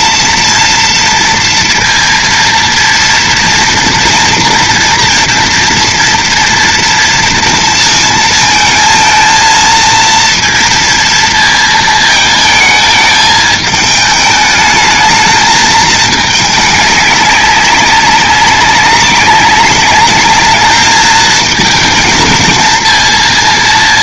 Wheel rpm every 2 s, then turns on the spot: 240, 230, 230, 230, 220, 230, 220, 220, 210, 190, 210, 230.
none